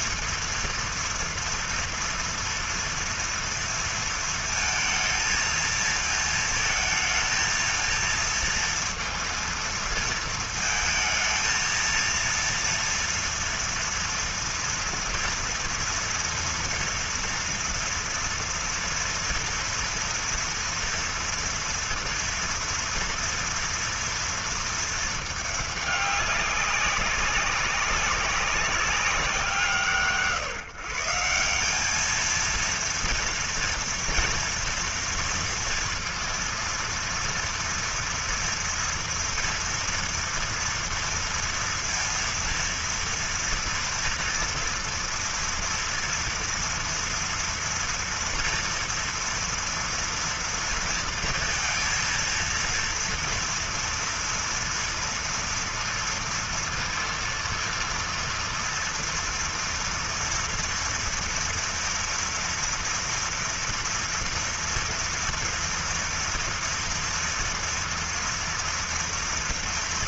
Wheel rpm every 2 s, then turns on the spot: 230, 230, 230, 230, 230, 230, 230, 230, 230, 230, 230, 240, 230, 200, 200, 150, 230, 230, 230, 230, 230, 230, 230, 230, 230, 230, 230, 230, 230, 230, 230, 230, 230, 230, 230.
none